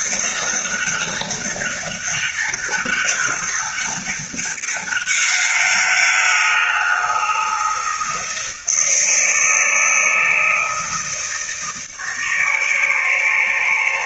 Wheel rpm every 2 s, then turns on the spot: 200, 200, 200, 180, 160, 160, 150.
none